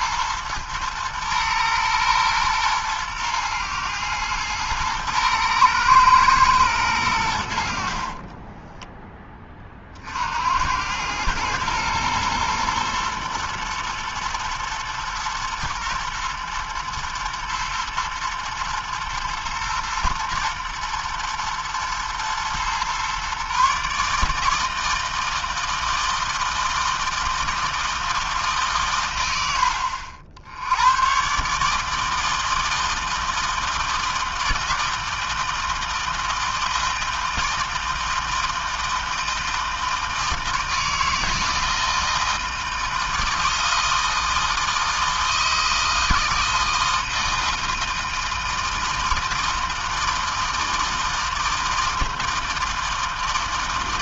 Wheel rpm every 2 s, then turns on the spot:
120, 120, 110, 100, 20, 110, 120, 110, 110, 110, 110, 130, 160, 160, 110, 120, 160, 160, 160, 160, 160, 160, 160, 160, 160, 160, 160.
none